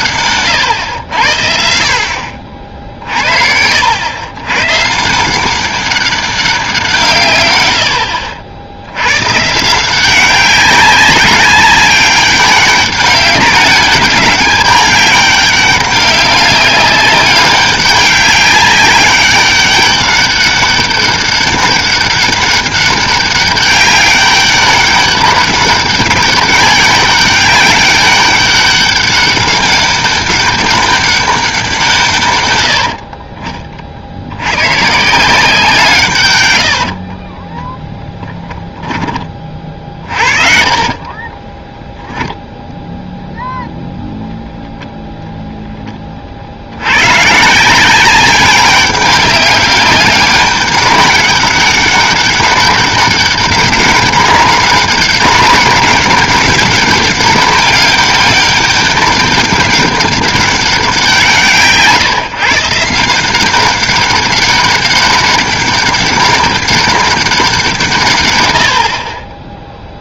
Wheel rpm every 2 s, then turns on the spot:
110, 70, 130, 180, 80, 190, 200, 200, 200, 200, 200, 200, 200, 200, 200, 200, 100, 110, 100, 10, 40, 0, 0, 80, 190, 200, 200, 200, 200, 200, 190, 150, 200, 200, 110.
36-42